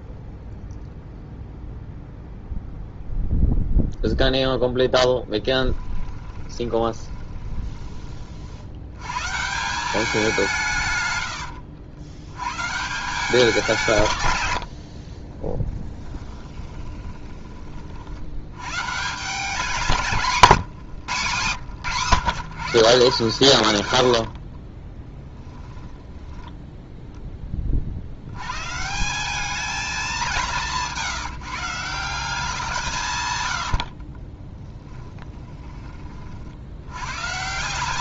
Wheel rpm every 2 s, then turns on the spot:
0, 0, 0, 20, 70, 170, 150, 100, 20, 110, 140, 90, 20, 10, 130, 180, 170, 20, 80.
6-8 14-18 20-22 24-26 30-32 34-36